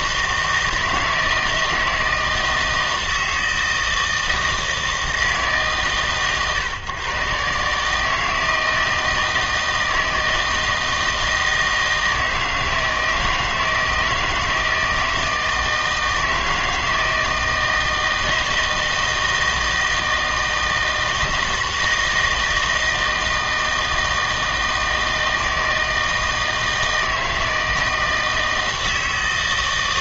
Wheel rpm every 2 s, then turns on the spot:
160, 160, 160, 130, 160, 160, 160, 160, 160, 160, 160, 160, 160, 160, 160.
none